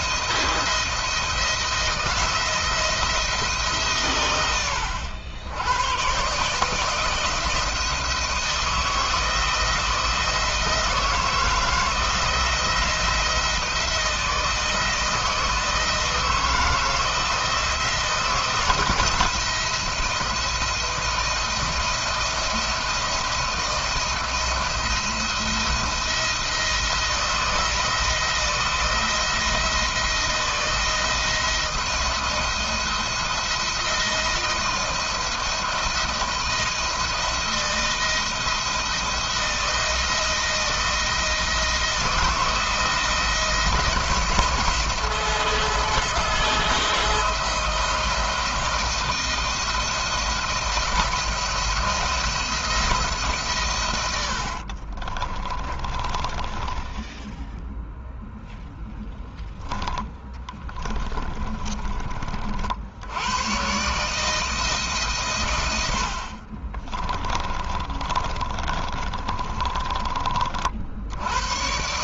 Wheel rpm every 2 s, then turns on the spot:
160, 160, 90, 140, 160, 160, 170, 160, 170, 170, 170, 170, 170, 170, 170, 170, 170, 170, 170, 170, 170, 170, 160, 160, 160, 170, 170, 70, 20, 0, 20, 60, 160, 40, 30, 50.
54-58 60-62 66-70